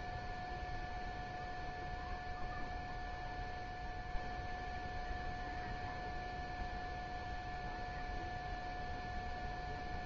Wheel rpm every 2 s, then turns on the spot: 0, 0, 0, 0, 0.
none